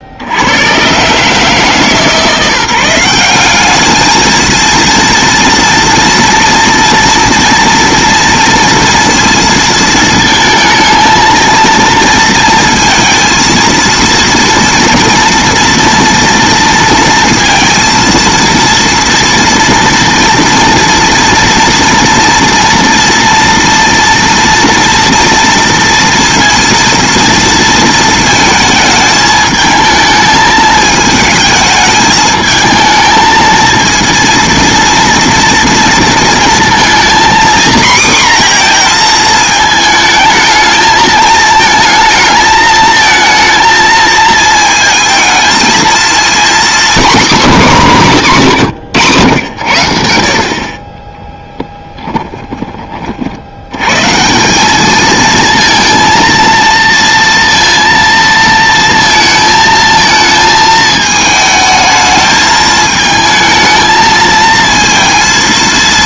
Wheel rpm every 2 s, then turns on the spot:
90, 170, 230, 230, 230, 220, 230, 230, 230, 230, 230, 230, 230, 230, 220, 220, 220, 230, 230, 240, 220, 220, 220, 240, 180, 40, 10, 190, 230, 230, 220, 220, 230.
none